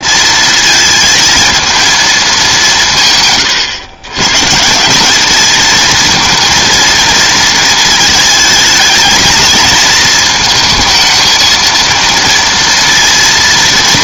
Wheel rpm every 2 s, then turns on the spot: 220, 170, 170, 230, 220, 220, 230.
none